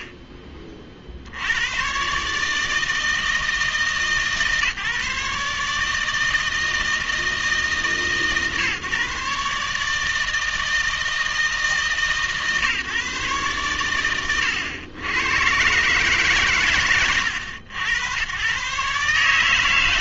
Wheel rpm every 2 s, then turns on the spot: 30, 150, 140, 160, 140, 160, 150, 100, 110, 130.
none